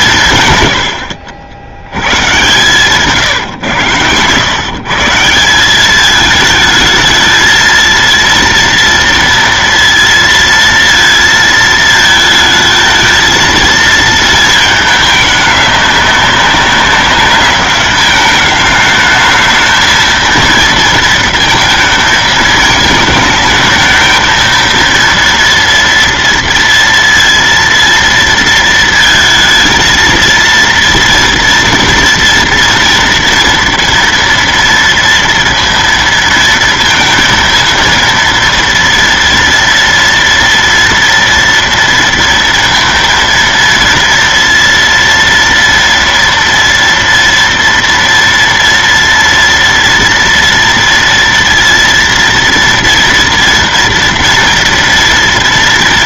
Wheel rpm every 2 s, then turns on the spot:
130, 120, 120, 220, 230, 230, 220, 220, 200, 210, 230, 220, 220, 230, 230, 230, 230, 230, 230, 230, 230, 230, 230, 230, 230, 230, 230, 230.
none